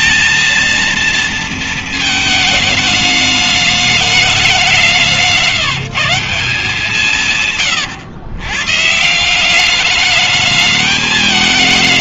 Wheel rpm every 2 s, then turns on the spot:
230, 210, 180, 180, 130, 210.
none